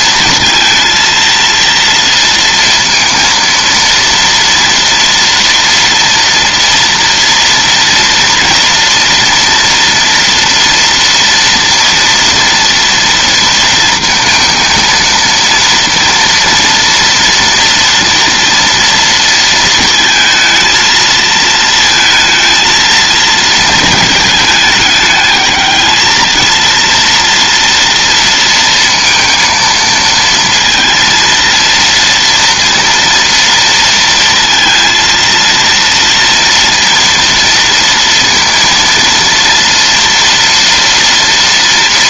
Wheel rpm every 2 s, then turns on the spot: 230, 230, 230, 230, 230, 230, 230, 230, 230, 230, 230, 230, 210, 230, 230, 230, 230, 230, 230, 230, 240.
none